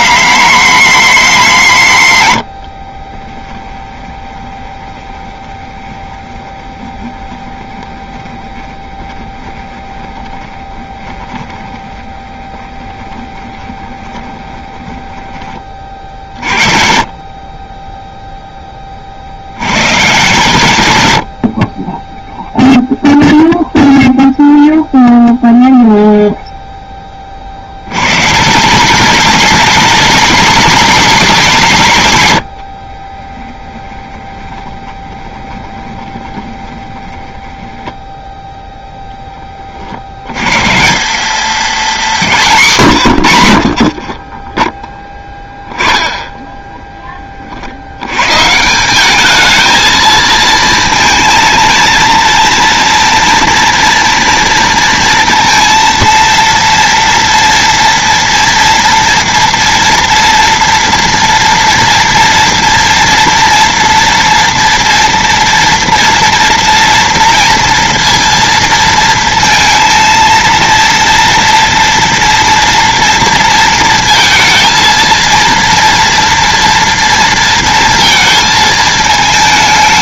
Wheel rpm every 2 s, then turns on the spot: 220, 50, 20, 20, 20, 20, 20, 20, 40, 20, 100, 0, 0, 10, 200, 240, 50, 20, 20, 10, 150, 150, 10, 10, 190, 230, 230, 230, 230, 230, 240, 240, 230, 230, 230, 230, 230, 230, 230, 220.
2-16 32-38